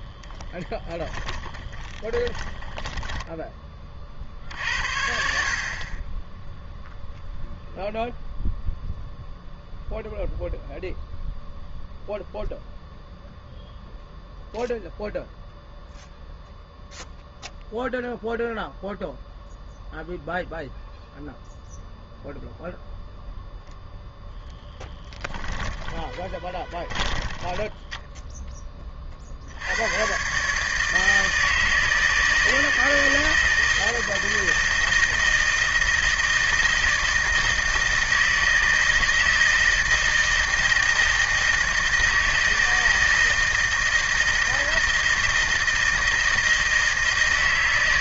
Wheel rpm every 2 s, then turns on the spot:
20, 10, 60, 10, 0, 0, 0, 0, 0, 0, 0, 0, 10, 20, 10, 140, 160, 160, 160, 160, 160, 160, 160, 160.
0-4 24-28